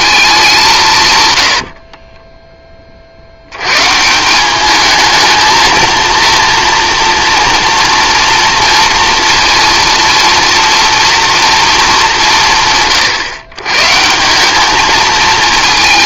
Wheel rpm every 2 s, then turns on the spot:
190, 20, 200, 230, 240, 240, 150, 200.
none